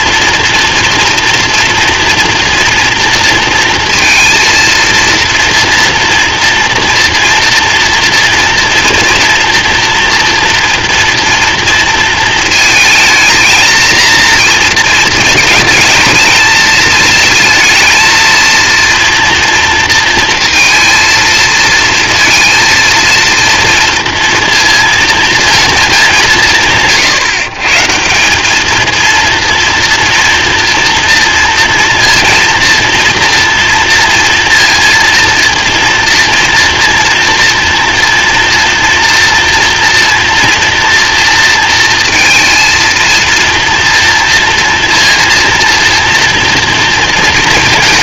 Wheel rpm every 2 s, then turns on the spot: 230, 230, 230, 230, 230, 240, 220, 220, 220, 230, 230, 230, 230, 140, 220, 230, 230, 230, 230, 230, 230, 230, 230, 230.
none